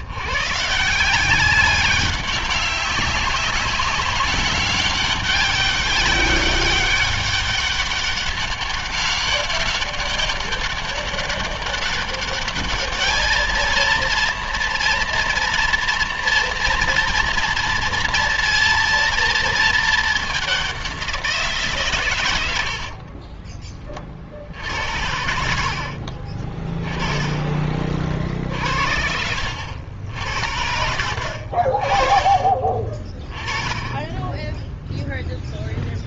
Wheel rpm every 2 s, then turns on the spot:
160, 190, 190, 200, 190, 200, 210, 230, 230, 230, 190, 50, 70, 20, 50, 60, 30, 0.
22-24